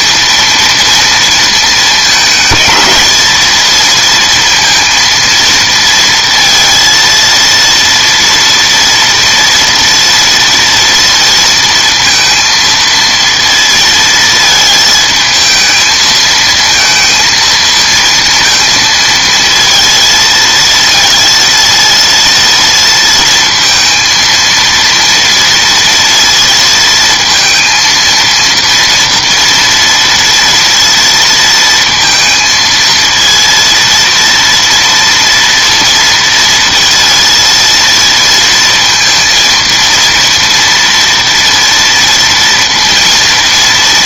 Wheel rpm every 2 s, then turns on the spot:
230, 210, 230, 230, 230, 230, 230, 220, 220, 230, 230, 230, 230, 230, 230, 230, 230, 230, 230, 230, 240, 230.
none